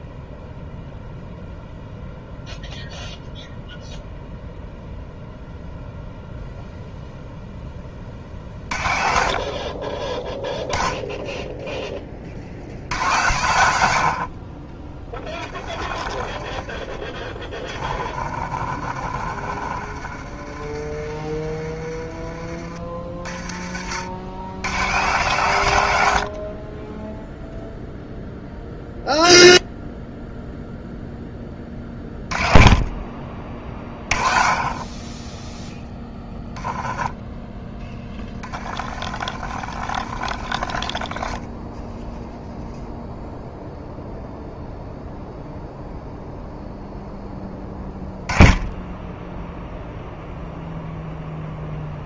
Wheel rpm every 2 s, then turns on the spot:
0, 0, 0, 0, 30, 10, 70, 30, 30, 40, 40, 40, 100, 40, 0, 0, 20, 30, 10, 30, 40, 0, 0, 0, 10, 0.
16-22 26-28 36-42